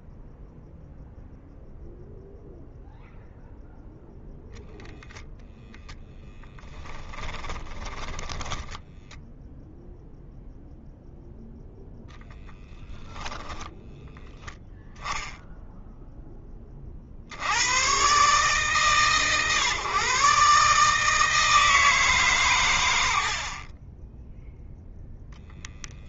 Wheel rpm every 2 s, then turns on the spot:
0, 0, 0, 10, 10, 0, 10, 0, 60, 130, 150, 110, 0.
6-10 12-14 22-24